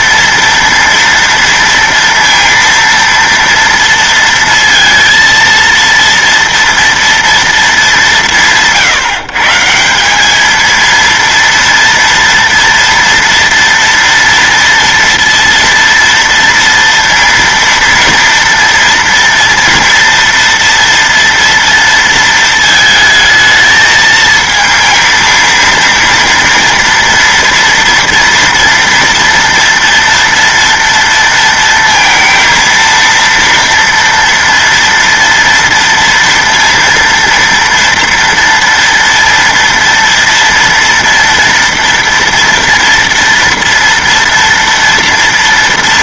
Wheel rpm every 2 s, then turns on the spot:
230, 230, 230, 230, 130, 220, 230, 230, 230, 230, 230, 220, 220, 230, 230, 230, 230, 230, 230, 230, 230, 230, 230.
none